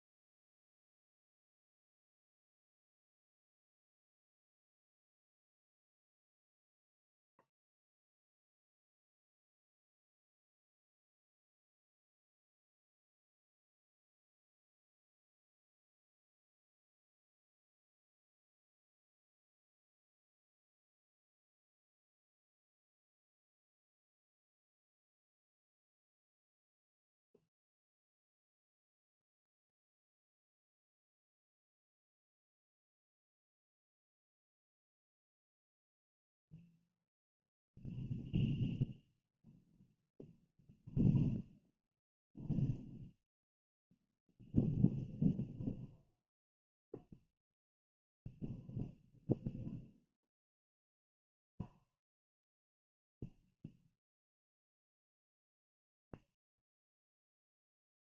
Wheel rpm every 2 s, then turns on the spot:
0, 0, 0, 0, 0, 0, 0, 0, 0, 0, 0, 0, 0, 0, 0, 0, 0, 0, 0, 0, 0, 0, 0, 0, 0, 0, 0, 0, 0.
none